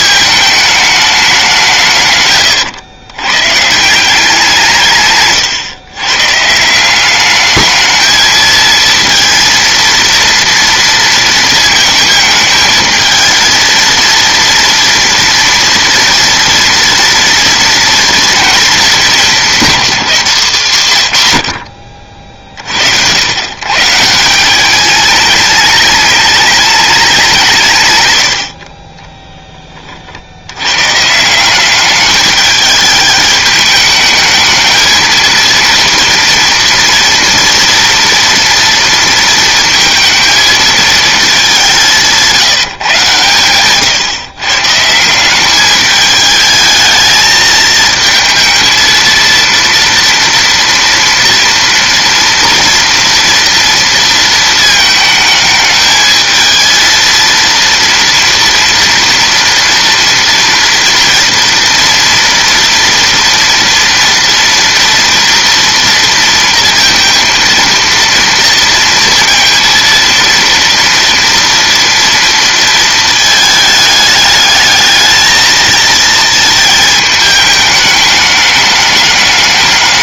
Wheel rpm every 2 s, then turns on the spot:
210, 110, 150, 190, 230, 230, 220, 230, 230, 220, 140, 90, 210, 200, 30, 130, 210, 230, 230, 230, 220, 140, 170, 220, 230, 230, 230, 220, 230, 230, 230, 230, 230, 230, 230, 230, 220, 220, 220, 210.
4-6